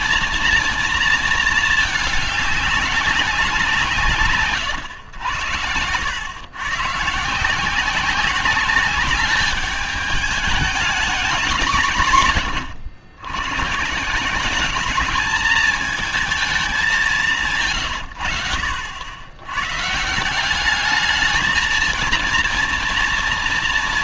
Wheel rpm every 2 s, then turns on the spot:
230, 210, 140, 130, 200, 210, 120, 190, 220, 100, 180, 230.
none